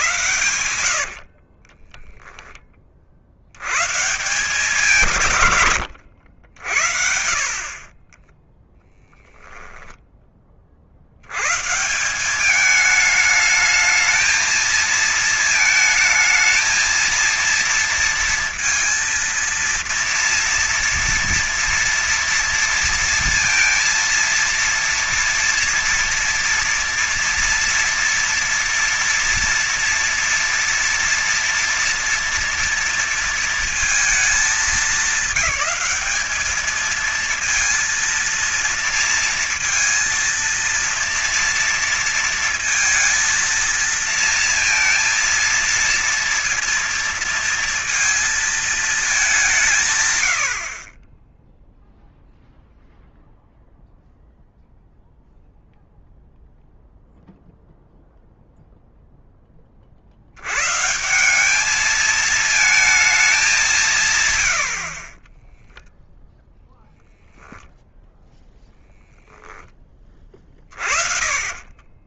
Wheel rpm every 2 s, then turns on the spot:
110, 20, 160, 90, 20, 20, 190, 220, 220, 230, 230, 230, 230, 230, 230, 230, 230, 210, 200, 230, 230, 230, 230, 230, 230, 100, 0, 0, 0, 0, 90, 220, 120, 0, 10, 20.
8-10